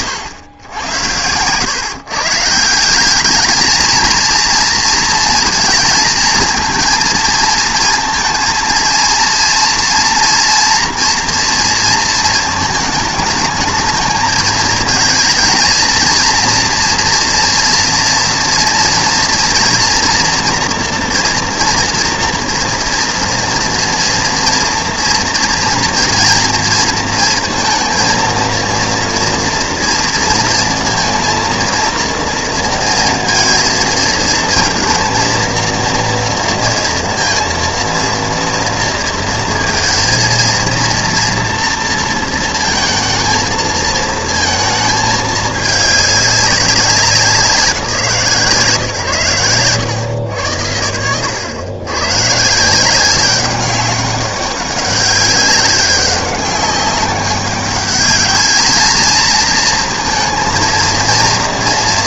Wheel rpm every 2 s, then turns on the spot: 110, 170, 230, 230, 230, 240, 220, 220, 230, 230, 230, 240, 230, 230, 230, 230, 230, 230, 230, 230, 240, 230, 220, 190, 140, 100, 170, 200, 200, 220, 230.
none